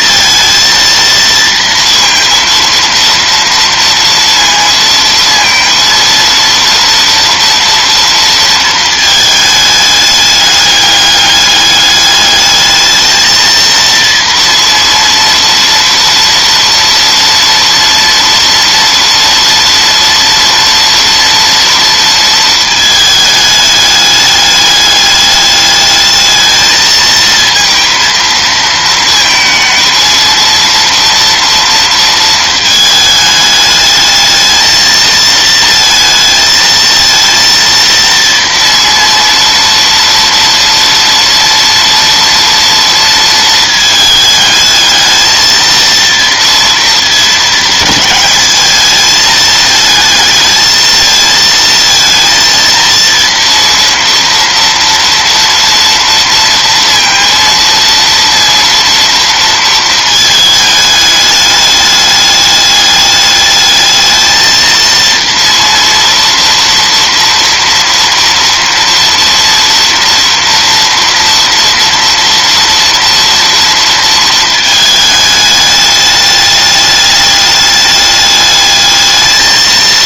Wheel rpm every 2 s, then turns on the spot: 230, 230, 230, 230, 230, 210, 210, 230, 230, 230, 230, 220, 210, 220, 220, 230, 220, 220, 230, 230, 230, 230, 220, 230, 210, 220, 230, 230, 230, 230, 220, 210, 220, 230, 230, 230, 230, 220, 210, 210.
none